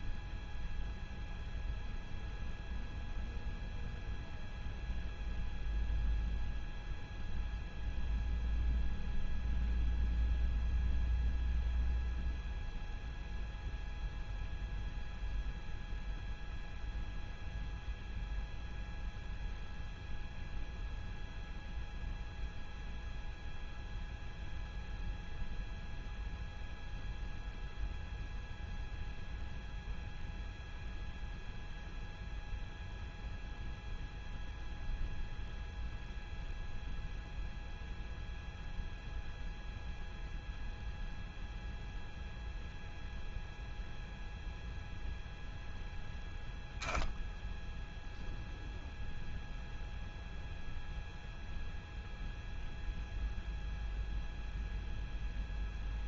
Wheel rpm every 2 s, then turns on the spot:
0, 0, 0, 0, 0, 0, 0, 0, 0, 0, 0, 0, 0, 0, 0, 0, 0, 0, 0, 0, 0, 0, 0, 0, 0, 0, 0, 0.
none